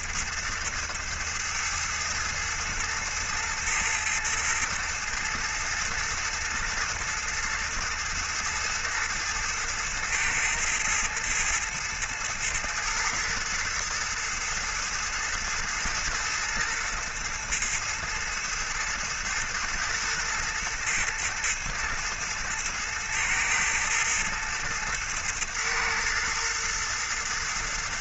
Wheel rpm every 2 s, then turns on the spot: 110, 110, 110, 120, 110, 110, 110, 110, 110, 110, 110, 110, 110, 110.
none